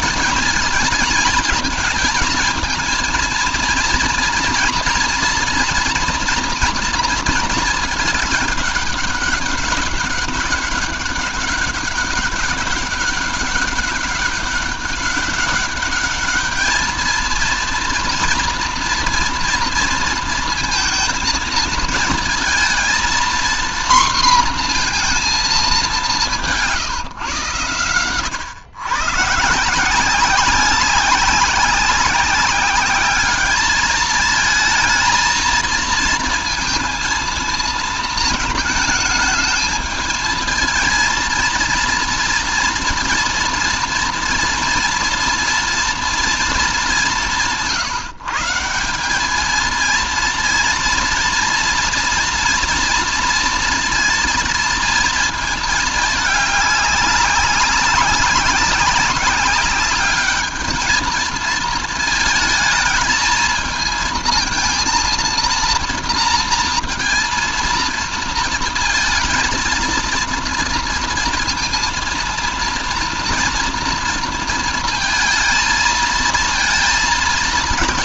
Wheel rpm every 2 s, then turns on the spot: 220, 240, 240, 230, 200, 200, 200, 200, 210, 240, 230, 230, 240, 170, 120, 190, 200, 220, 230, 220, 230, 230, 230, 210, 160, 230, 230, 230, 210, 200, 220, 220, 230, 230, 230, 230, 230, 230, 230.
none